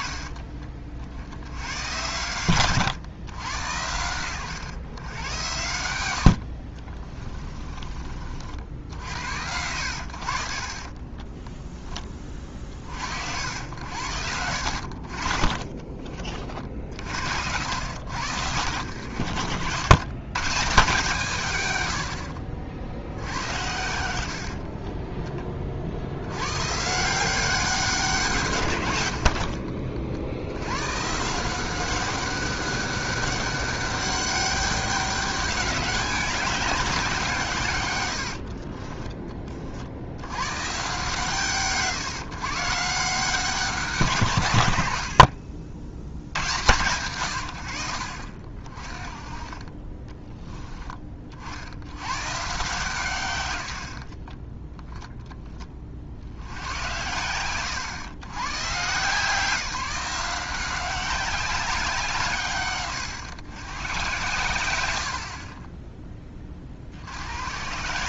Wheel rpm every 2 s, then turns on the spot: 40, 120, 120, 50, 60, 50, 40, 70, 50, 90, 150, 70, 50, 130, 150, 100, 200, 200, 190, 40, 120, 150, 120, 110, 40, 20, 140, 10, 90, 130, 180, 140, 100, 40.
6-8 24-26 38-40